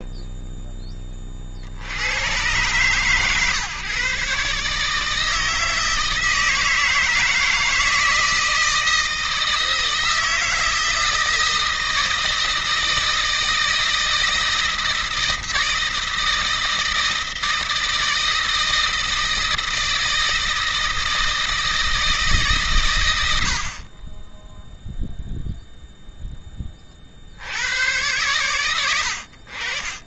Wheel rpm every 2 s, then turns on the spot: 10, 120, 150, 160, 160, 160, 160, 160, 160, 160, 160, 140, 0, 20, 100.
none